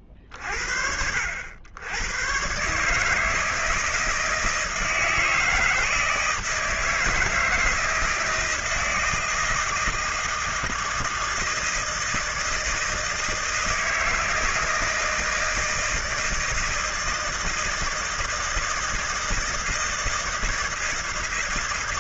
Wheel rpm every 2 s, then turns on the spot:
50, 120, 160, 160, 160, 160, 160, 160, 160, 160, 160.
none